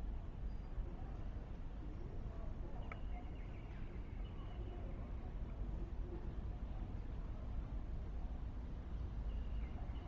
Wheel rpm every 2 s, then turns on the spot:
0, 0, 0, 0, 0.
none